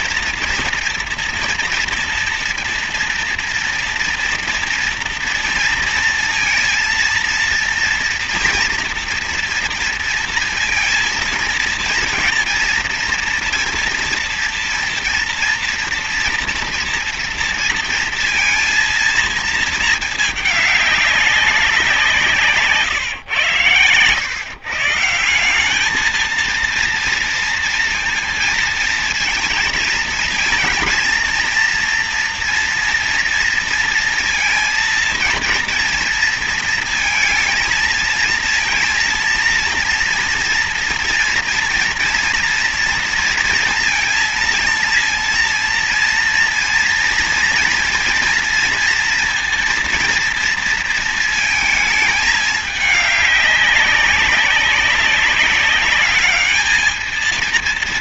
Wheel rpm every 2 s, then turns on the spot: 230, 230, 230, 230, 240, 230, 230, 230, 230, 230, 210, 160, 140, 230, 230, 230, 230, 230, 220, 230, 230, 230, 230, 230, 230, 230, 210, 200, 210.
none